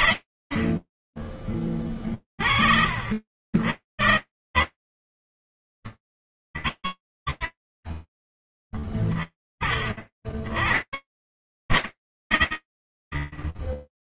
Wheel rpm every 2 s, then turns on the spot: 30, 80, 20, 30, 20, 70, 20.
none